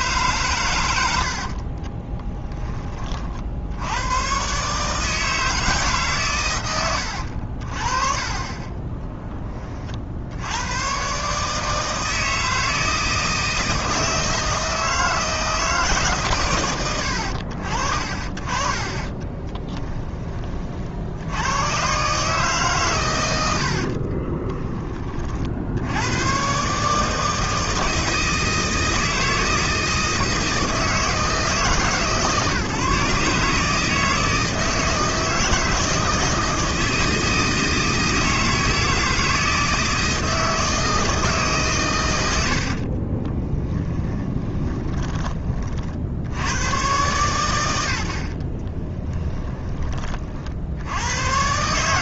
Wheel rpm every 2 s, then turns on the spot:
110, 20, 140, 110, 20, 100, 160, 160, 110, 30, 40, 140, 20, 140, 160, 160, 140, 160, 160, 160, 160, 70, 20, 100, 40, 80.
18-20 42-46 48-50